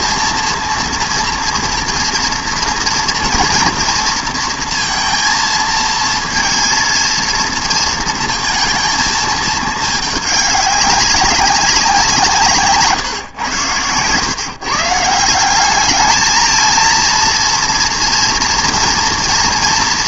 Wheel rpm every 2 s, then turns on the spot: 230, 230, 230, 230, 230, 200, 160, 130, 220, 230.
none